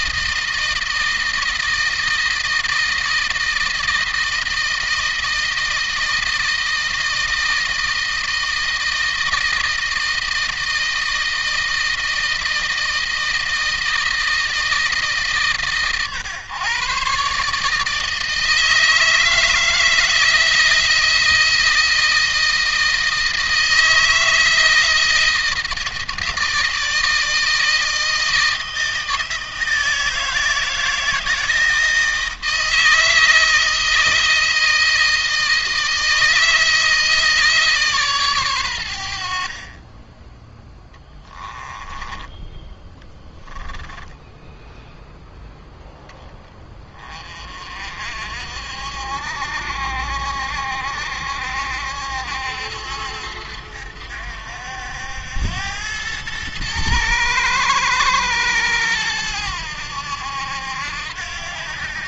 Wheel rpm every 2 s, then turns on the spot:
160, 160, 160, 160, 160, 160, 160, 150, 140, 160, 160, 160, 160, 160, 160, 160, 160, 160, 160, 90, 10, 10, 0, 20, 60, 70, 70, 80, 110, 100, 80.
40-44